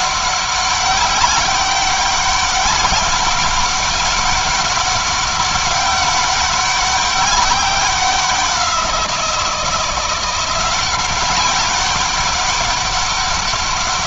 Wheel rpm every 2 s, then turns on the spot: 190, 200, 200, 200, 180, 180, 200.
none